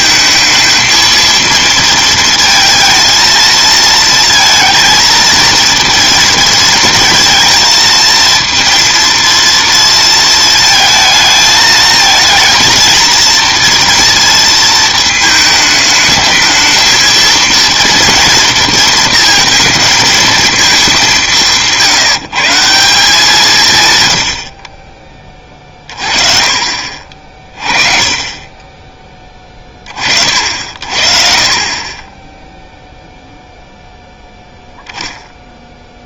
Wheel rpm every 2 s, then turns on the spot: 220, 230, 220, 230, 230, 220, 230, 220, 220, 230, 220, 170, 40, 40, 20, 60, 0, 0.
none